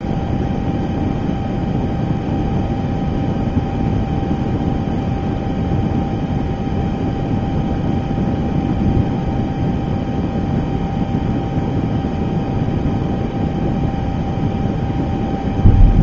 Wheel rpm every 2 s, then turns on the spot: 0, 0, 0, 0, 0, 0, 0, 0.
none